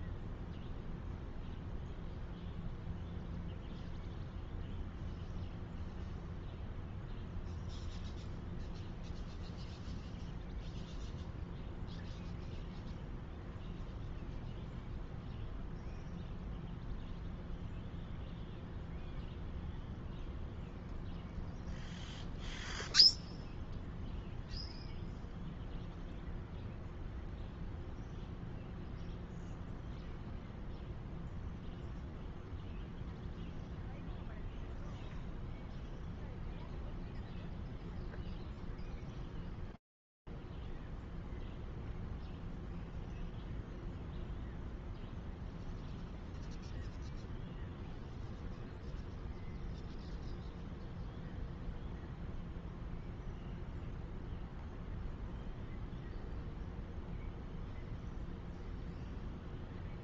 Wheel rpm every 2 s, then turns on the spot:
0, 0, 0, 0, 0, 0, 0, 0, 0, 0, 0, 0, 0, 0, 0, 0, 0, 0, 0, 0, 0, 0, 0, 0, 0, 0, 0, 0, 0, 0.
none